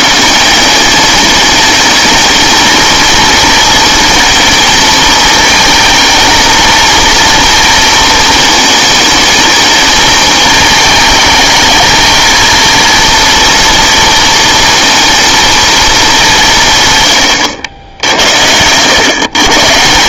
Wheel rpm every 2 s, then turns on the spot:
180, 220, 230, 230, 220, 210, 230, 230, 150, 100.
none